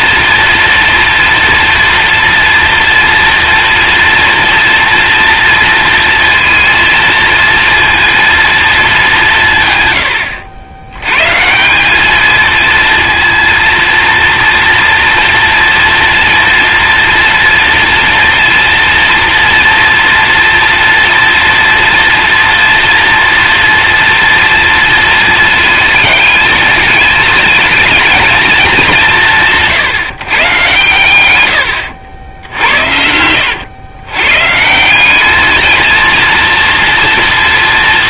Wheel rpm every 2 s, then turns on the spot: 230, 230, 230, 230, 230, 100, 220, 240, 230, 230, 230, 230, 240, 220, 230, 150, 80, 140, 230.
none